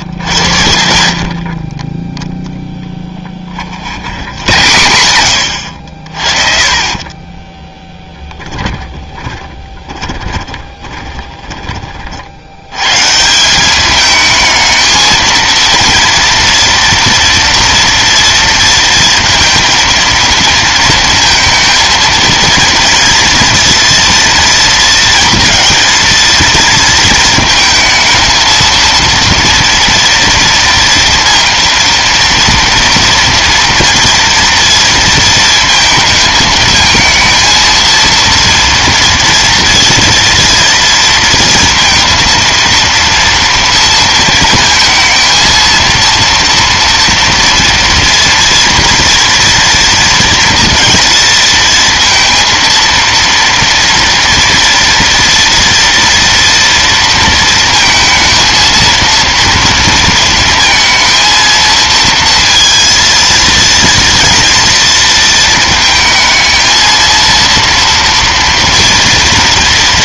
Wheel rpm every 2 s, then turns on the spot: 90, 10, 90, 30, 20, 20, 120, 220, 230, 220, 230, 230, 230, 220, 230, 230, 230, 230, 220, 230, 230, 230, 220, 230, 230, 230, 230, 230, 230, 230, 230, 230, 230, 220, 230.
0-4 6-12